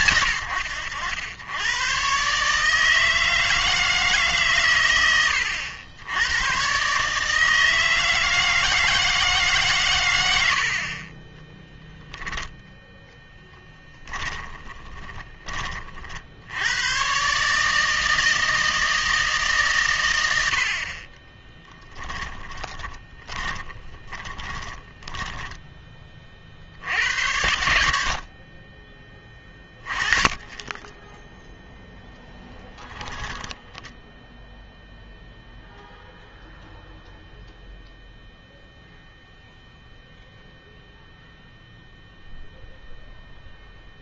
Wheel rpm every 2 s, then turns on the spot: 70, 150, 120, 130, 160, 50, 0, 20, 100, 160, 60, 20, 20, 60, 20, 20, 0, 0, 0, 0, 0, 0.
14-16 22-26